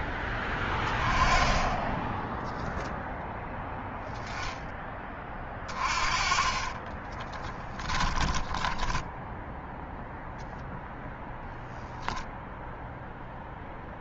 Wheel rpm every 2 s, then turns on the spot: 10, 0, 20, 20, 10, 0, 0.
6-10